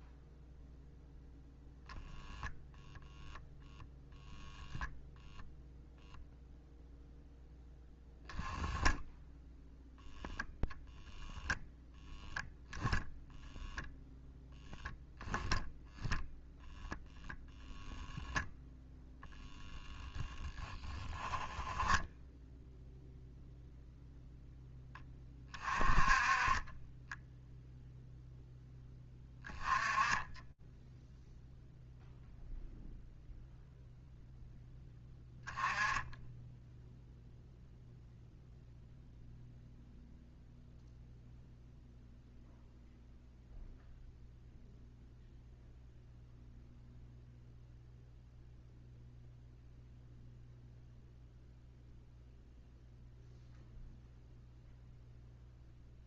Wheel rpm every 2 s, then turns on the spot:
0, 0, 0, 0, 10, 0, 0, 0, 0, 0, 10, 0, 10, 20, 10, 10, 0, 10, 0, 0, 0, 0, 0, 0, 0, 0, 0, 0.
none